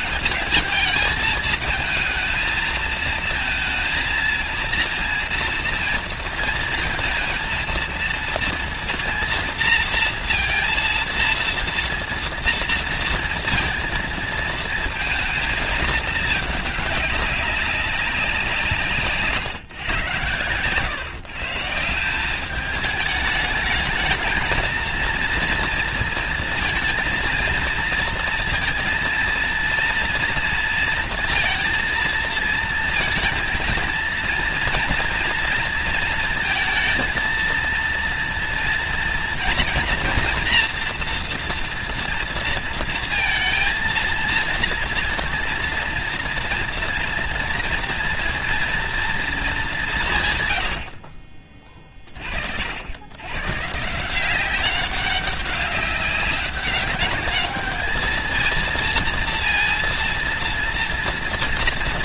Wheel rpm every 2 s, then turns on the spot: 210, 220, 230, 230, 230, 230, 230, 230, 210, 180, 120, 190, 230, 230, 230, 230, 230, 230, 230, 230, 230, 230, 230, 230, 230, 120, 50, 180, 200, 230, 230.
20-22